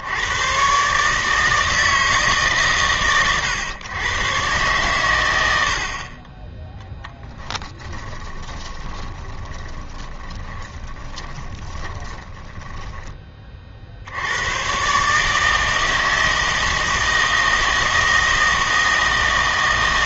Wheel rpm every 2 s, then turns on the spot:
120, 140, 120, 10, 20, 30, 10, 120, 160, 160.
8-14